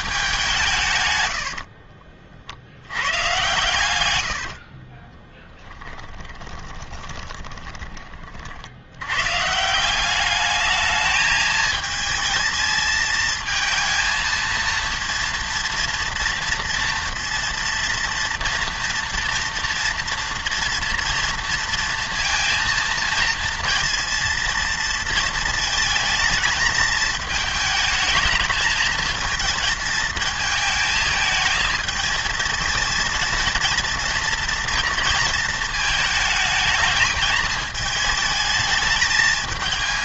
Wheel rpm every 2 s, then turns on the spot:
170, 80, 50, 20, 80, 210, 220, 230, 230, 230, 230, 230, 230, 220, 220, 220, 230, 230, 220, 220.
4-8